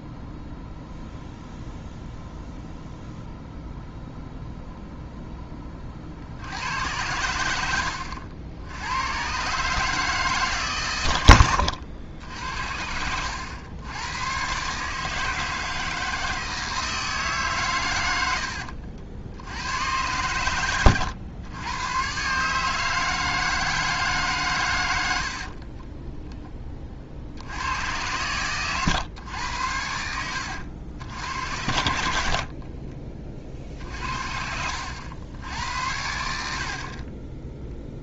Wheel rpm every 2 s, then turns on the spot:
0, 0, 0, 80, 80, 130, 70, 130, 160, 70, 100, 150, 120, 20, 110, 80, 50, 70, 60.
18-20 32-34